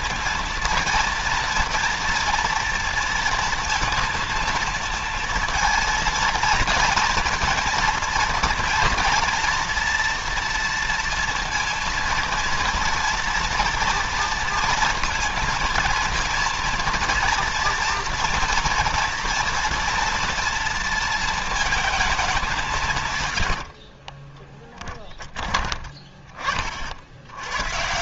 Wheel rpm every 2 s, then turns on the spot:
230, 230, 230, 230, 230, 230, 230, 230, 230, 230, 230, 190, 20, 30.
24-26